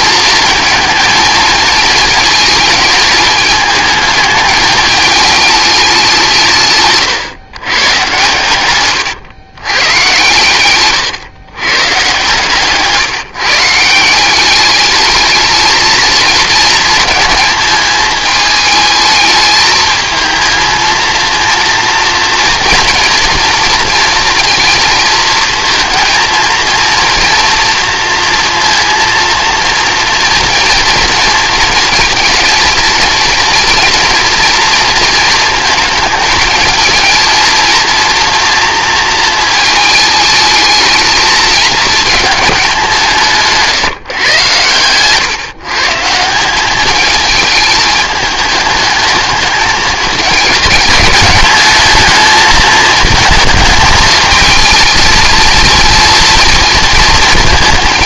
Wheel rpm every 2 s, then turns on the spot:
220, 220, 220, 140, 120, 130, 160, 210, 230, 220, 230, 230, 230, 230, 230, 230, 230, 230, 230, 220, 220, 190, 130, 210, 210, 200, 220, 220, 230.
none